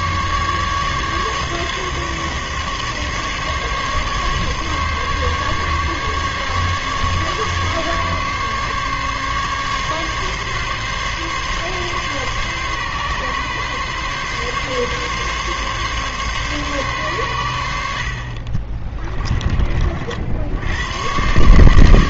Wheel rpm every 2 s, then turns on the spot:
150, 140, 140, 140, 140, 140, 140, 140, 130, 30, 80.
18-20